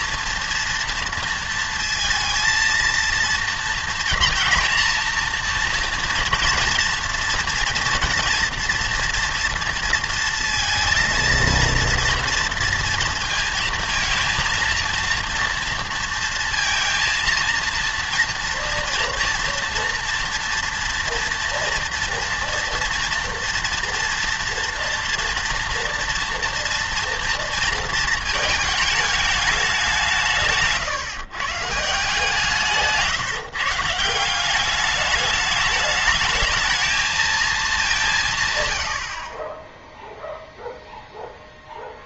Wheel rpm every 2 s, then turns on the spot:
230, 230, 240, 230, 230, 230, 230, 230, 230, 230, 230, 240, 230, 230, 220, 150, 160, 190, 220, 150, 0.
none